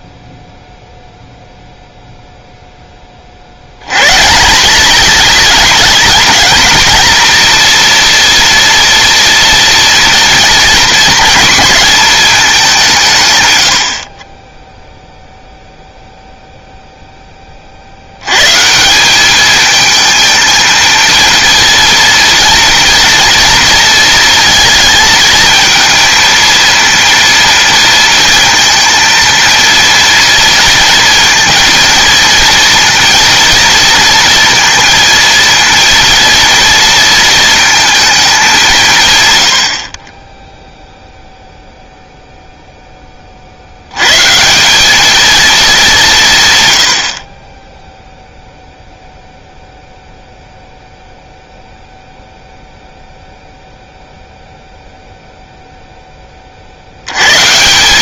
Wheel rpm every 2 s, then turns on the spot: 0, 10, 190, 230, 230, 240, 190, 10, 0, 150, 220, 230, 230, 230, 230, 230, 230, 230, 230, 180, 0, 0, 190, 100, 0, 0, 0, 0, 60.
none